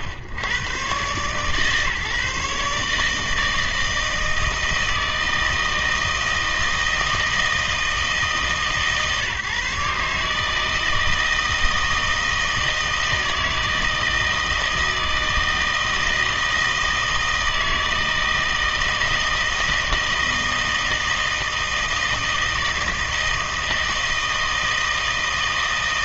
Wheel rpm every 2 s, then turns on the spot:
110, 150, 160, 160, 140, 160, 160, 160, 160, 160, 160, 160, 160.
none